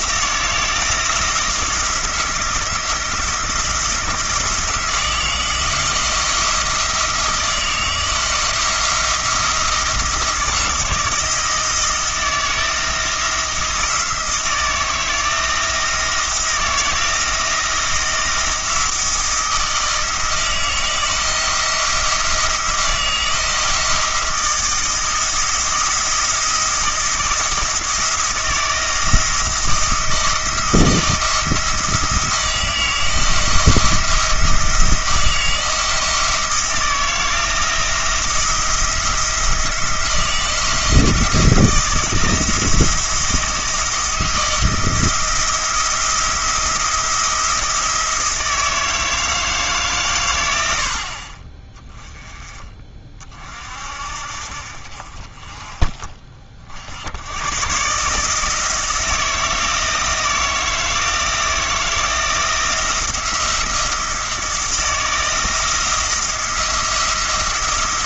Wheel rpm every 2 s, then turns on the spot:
170, 170, 160, 160, 170, 160, 170, 160, 160, 170, 160, 160, 160, 170, 160, 170, 170, 160, 170, 170, 170, 160, 170, 170, 160, 80, 30, 50, 70, 160, 160, 170, 170, 170.
none